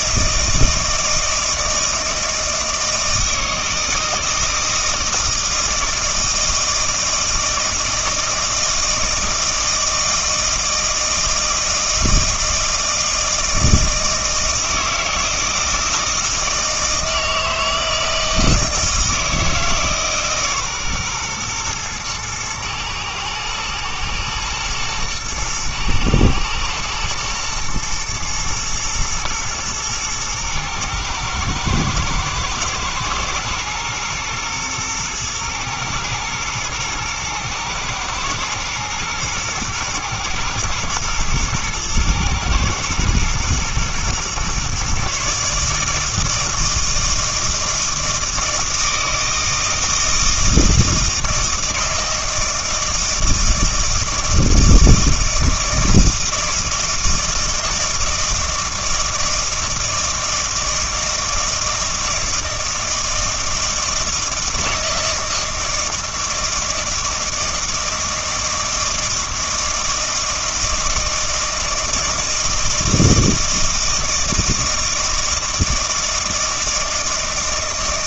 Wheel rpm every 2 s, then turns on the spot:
160, 160, 160, 160, 160, 160, 160, 160, 160, 160, 130, 110, 110, 120, 110, 110, 110, 120, 110, 120, 110, 120, 130, 160, 160, 160, 170, 160, 160, 160, 160, 160, 160, 160, 160, 160, 160, 160, 160.
none